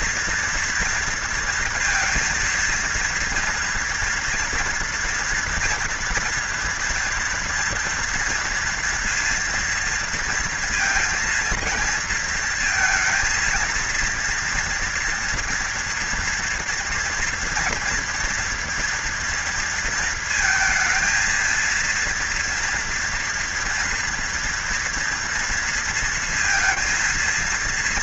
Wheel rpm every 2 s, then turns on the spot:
240, 230, 230, 230, 230, 230, 230, 230, 230, 230, 230, 230, 230, 230.
none